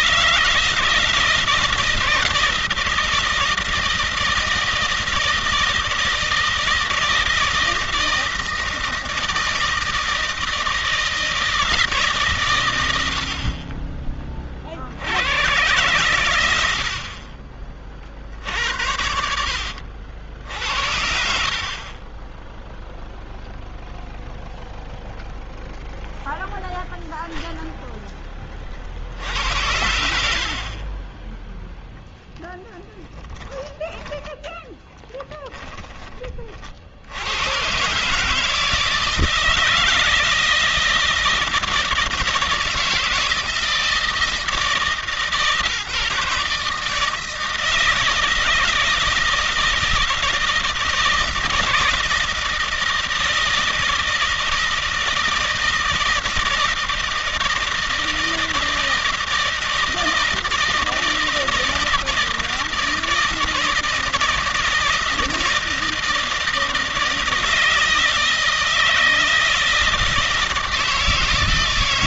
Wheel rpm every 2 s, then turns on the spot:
170, 160, 160, 160, 160, 160, 90, 70, 70, 80, 60, 0, 0, 0, 50, 20, 10, 10, 70, 160, 160, 160, 150, 160, 160, 160, 160, 160, 160, 160, 160, 160, 160, 160, 160, 160.
20-22 30-34